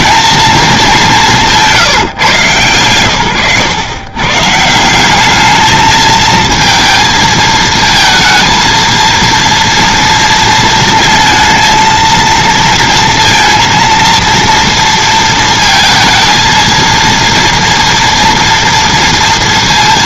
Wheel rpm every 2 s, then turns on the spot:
200, 120, 180, 220, 230, 230, 230, 230, 230, 230.
none